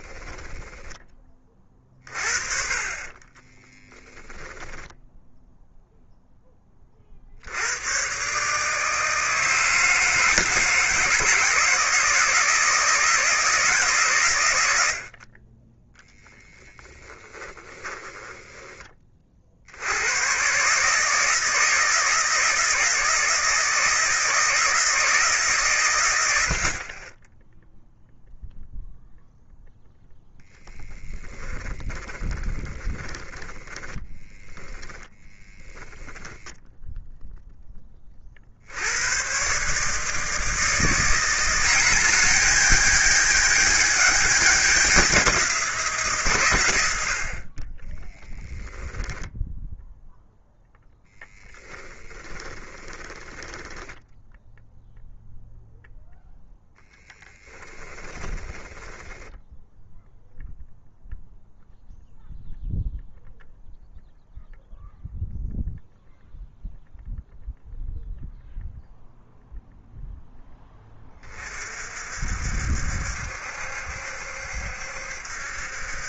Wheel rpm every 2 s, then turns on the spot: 20, 40, 10, 40, 160, 160, 160, 70, 10, 30, 150, 160, 150, 30, 0, 30, 20, 10, 0, 100, 170, 210, 190, 80, 10, 0, 10, 0, 10, 10, 0, 0, 0, 0, 0, 20, 70, 70.
2-6 30-36 48-50 52-54 58-60